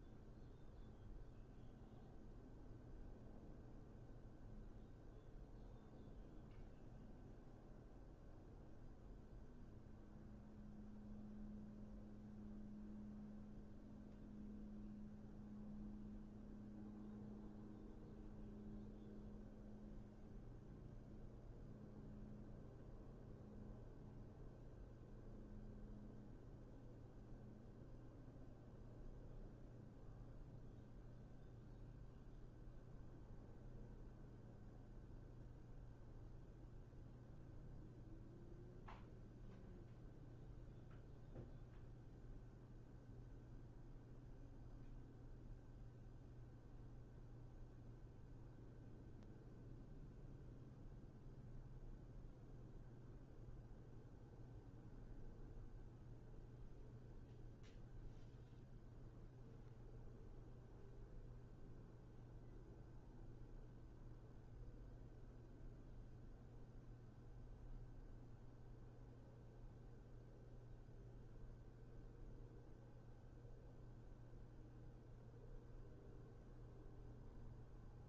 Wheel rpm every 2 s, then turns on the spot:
0, 0, 0, 0, 0, 0, 0, 0, 0, 0, 0, 0, 0, 0, 0, 0, 0, 0, 0, 0, 0, 0, 0, 0, 0, 0, 0, 0, 0, 0, 0, 0, 0, 0, 0, 0, 0, 0, 0.
none